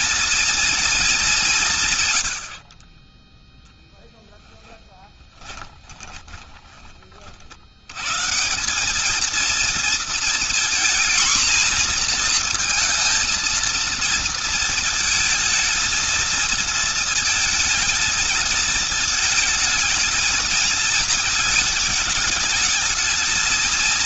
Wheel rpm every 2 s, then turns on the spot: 210, 40, 20, 40, 210, 240, 230, 220, 230, 220, 220, 220.
2-6